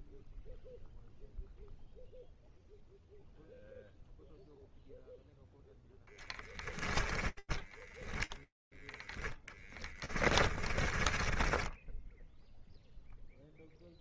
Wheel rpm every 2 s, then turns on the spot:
0, 0, 0, 10, 20, 30, 0.
6-12